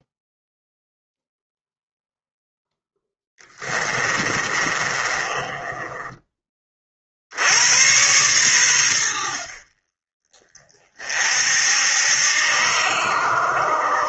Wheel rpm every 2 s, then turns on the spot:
0, 0, 30, 20, 110, 40, 70.
4-6